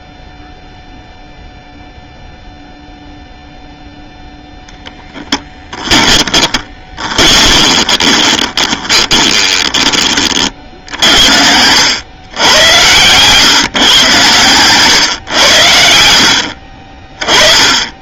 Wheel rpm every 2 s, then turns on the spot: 0, 0, 0, 20, 20, 30, 110, 130, 60.
6-10